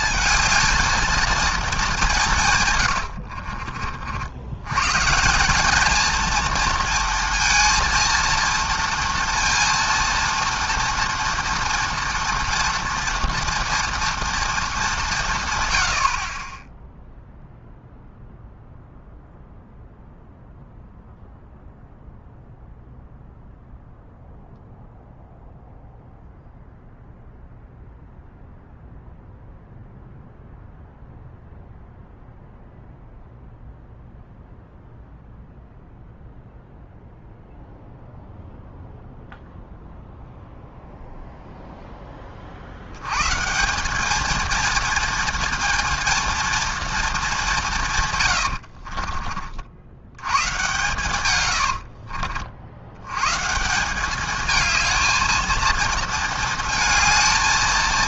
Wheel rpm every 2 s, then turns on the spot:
220, 120, 120, 230, 230, 230, 230, 210, 10, 0, 0, 0, 0, 0, 0, 0, 0, 0, 0, 0, 0, 80, 230, 230, 60, 120, 90, 220, 220.
2-4 48-50